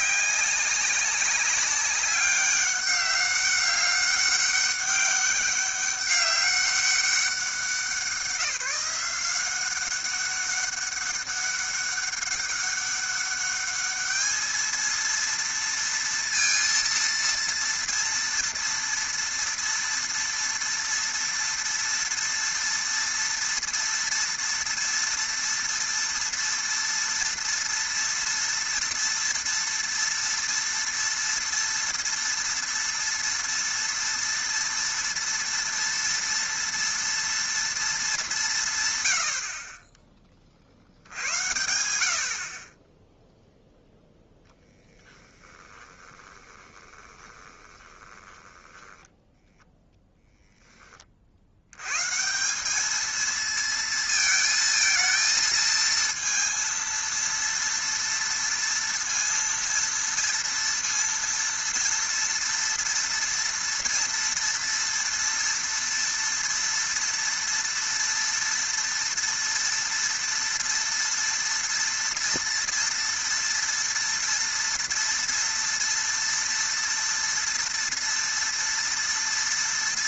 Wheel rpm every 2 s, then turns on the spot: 190, 200, 200, 200, 180, 200, 200, 220, 230, 230, 230, 230, 230, 230, 230, 230, 230, 230, 230, 160, 50, 40, 10, 20, 10, 10, 190, 220, 230, 230, 230, 230, 230, 230, 230, 230, 230, 230, 230, 230.
46-50